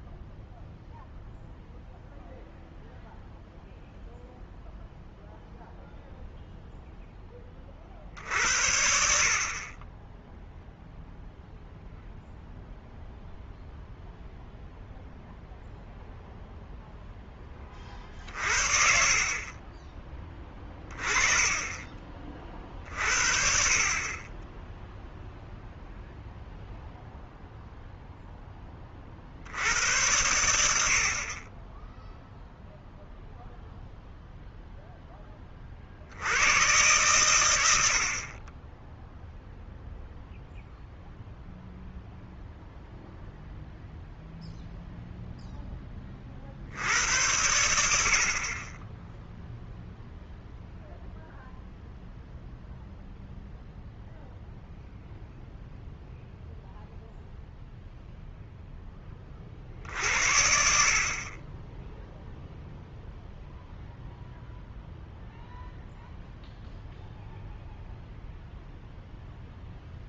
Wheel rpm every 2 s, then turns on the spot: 0, 0, 0, 0, 60, 0, 0, 0, 0, 50, 20, 40, 10, 0, 20, 70, 0, 0, 110, 20, 0, 0, 0, 70, 30, 0, 0, 0, 0, 0, 50, 0, 0, 0, 0.
none